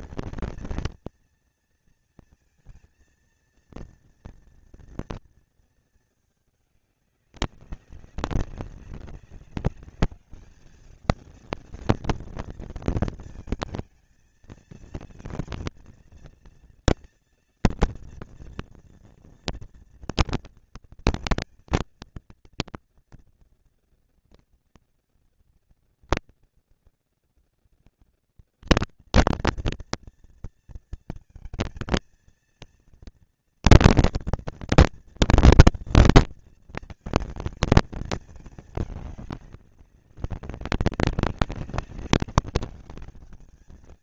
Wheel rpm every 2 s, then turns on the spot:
230, 230, 230, 220, 200, 210, 230, 230, 230, 230, 230, 230, 230, 230, 230, 230, 230, 240, 230, 220, 190, 190.
none